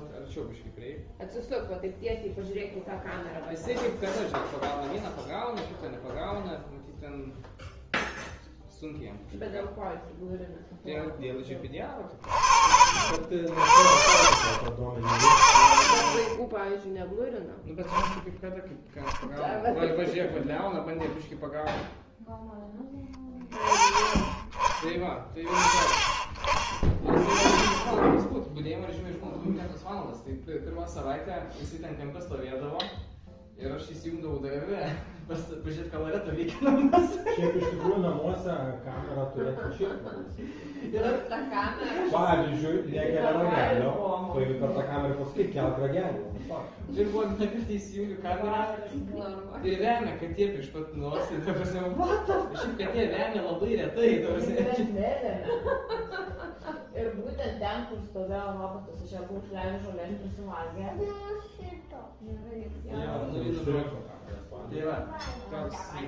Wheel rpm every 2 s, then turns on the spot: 0, 0, 0, 0, 0, 0, 50, 60, 20, 10, 0, 10, 20, 20, 0, 0, 0, 0, 0, 0, 0, 0, 0, 0, 0, 0, 0, 0, 0, 0, 0, 0, 0.
none